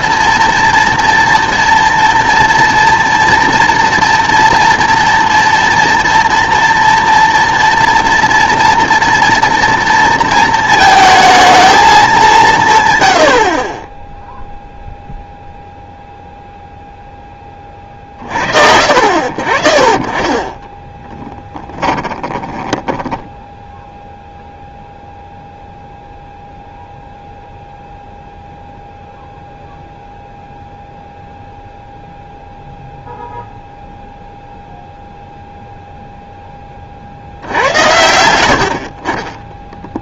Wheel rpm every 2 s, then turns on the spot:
230, 240, 240, 230, 230, 220, 140, 0, 0, 50, 20, 10, 0, 0, 0, 0, 0, 0, 20, 70.
20-24